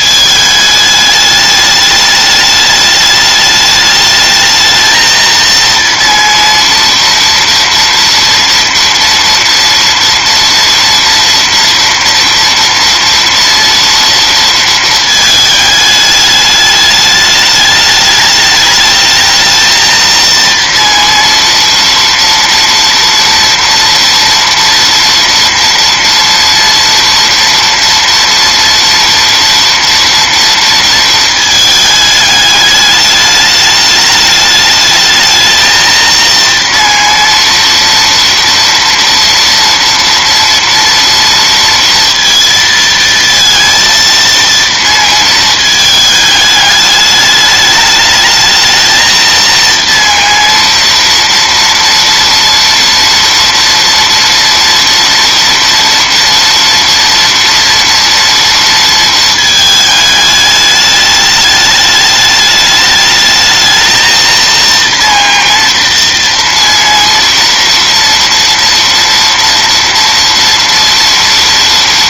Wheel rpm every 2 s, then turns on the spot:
220, 210, 220, 230, 230, 240, 230, 230, 210, 210, 230, 230, 240, 240, 230, 230, 210, 210, 230, 240, 230, 230, 230, 210, 220, 230, 230, 230, 230, 230, 210, 210, 230, 230, 230, 230.
none